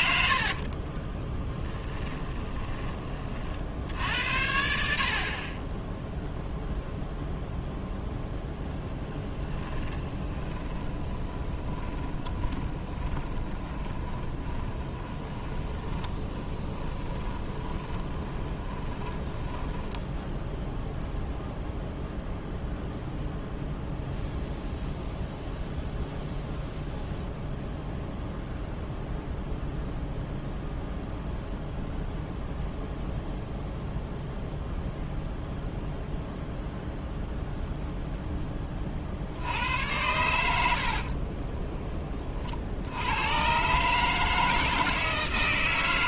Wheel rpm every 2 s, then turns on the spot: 20, 20, 90, 0, 10, 20, 20, 20, 20, 20, 0, 0, 0, 0, 0, 0, 0, 0, 0, 40, 60, 80, 160.
0-2 8-20 40-42